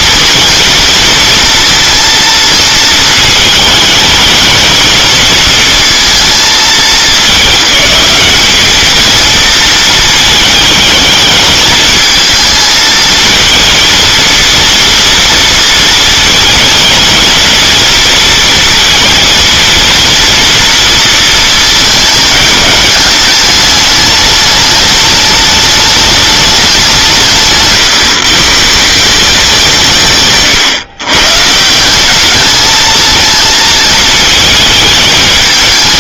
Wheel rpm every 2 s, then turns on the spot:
230, 220, 220, 210, 220, 210, 230, 230, 220, 230, 230, 210, 210, 190, 160, 130, 220, 220.
none